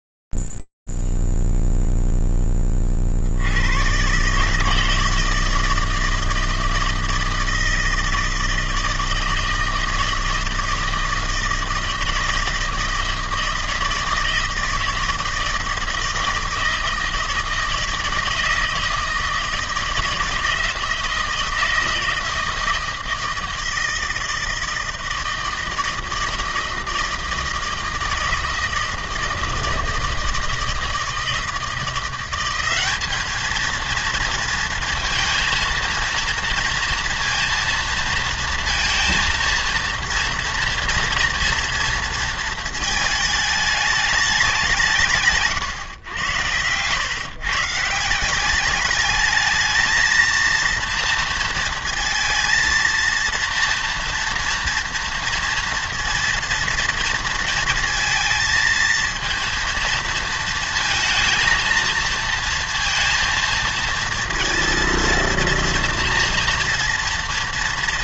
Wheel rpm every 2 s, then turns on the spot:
0, 0, 100, 160, 160, 160, 160, 160, 160, 160, 160, 160, 160, 160, 160, 160, 190, 230, 230, 230, 230, 220, 200, 110, 190, 230, 230, 230, 230, 220, 220, 230, 230, 240.
46-48